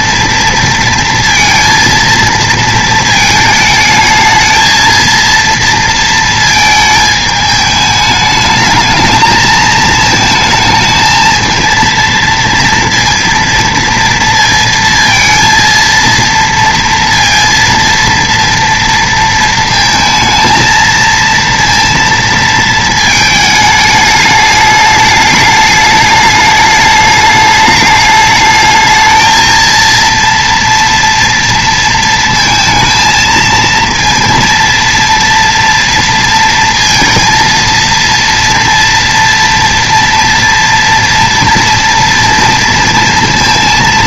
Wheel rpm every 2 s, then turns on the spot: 230, 230, 220, 220, 220, 220, 230, 230, 230, 230, 230, 230, 210, 210, 220, 230, 230, 230, 230, 240, 230, 230.
none